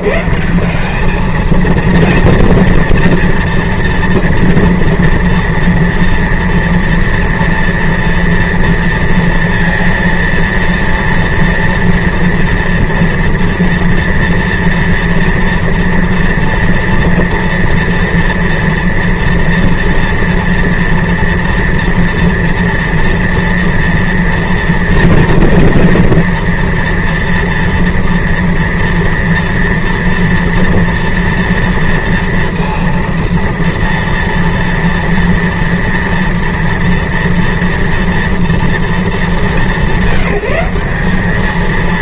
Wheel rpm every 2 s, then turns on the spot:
90, 230, 230, 230, 230, 230, 230, 230, 230, 230, 230, 230, 230, 230, 230, 230, 230, 230, 230, 230, 190.
none